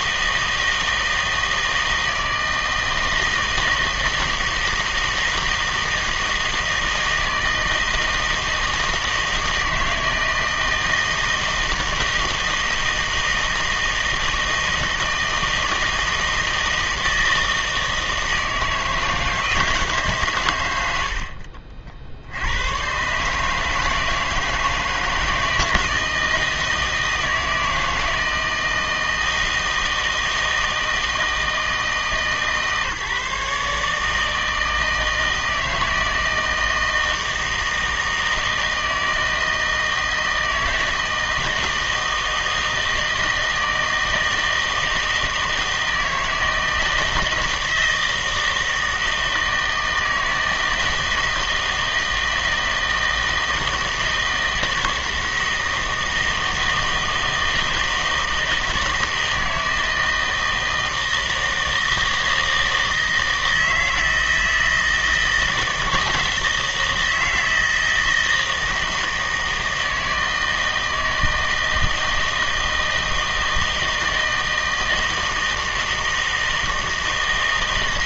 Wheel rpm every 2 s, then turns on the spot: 160, 160, 160, 160, 160, 160, 160, 160, 160, 160, 100, 110, 160, 160, 160, 160, 150, 160, 160, 160, 160, 160, 160, 160, 160, 160, 160, 160, 160, 160, 160, 160, 160, 160, 160, 160, 160, 160, 160.
none